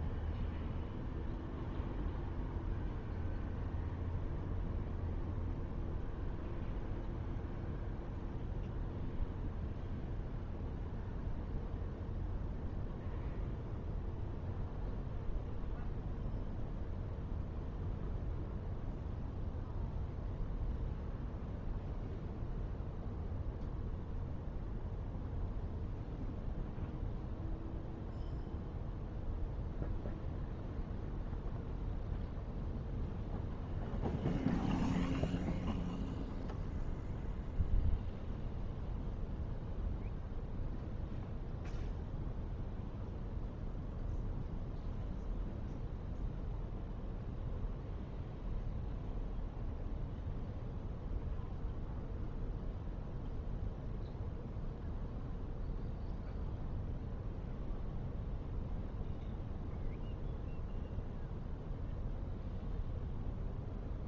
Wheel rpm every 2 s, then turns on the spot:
0, 0, 0, 0, 0, 0, 0, 0, 0, 0, 0, 0, 0, 0, 0, 0, 0, 0, 0, 0, 0, 0, 0, 0, 0, 0, 0, 0, 0, 0, 0, 0.
none